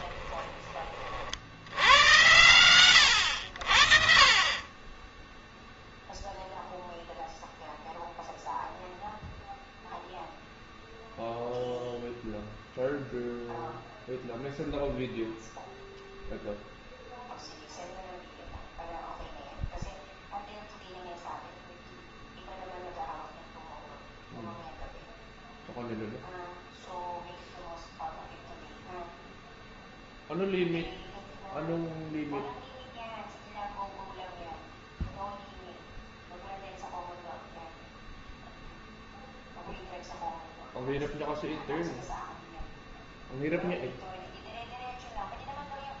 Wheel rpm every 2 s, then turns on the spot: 20, 100, 30, 0, 0, 0, 0, 0, 0, 0, 0, 0, 0, 0, 0, 0, 0, 0, 0, 0, 0, 0, 0.
none